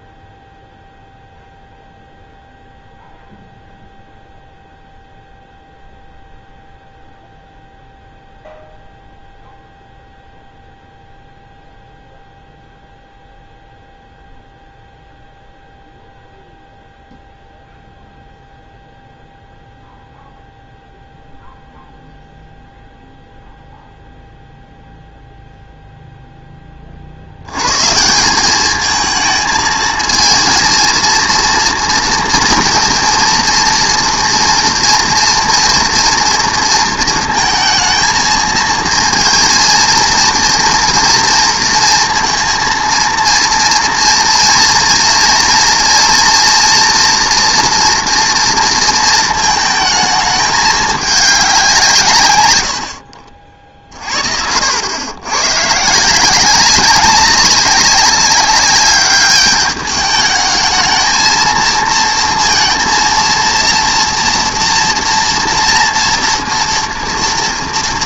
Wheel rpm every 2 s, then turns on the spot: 0, 0, 0, 0, 0, 0, 0, 0, 0, 0, 0, 0, 0, 10, 190, 230, 230, 230, 230, 230, 230, 230, 230, 230, 230, 210, 100, 70, 190, 200, 210, 230, 240, 230.
none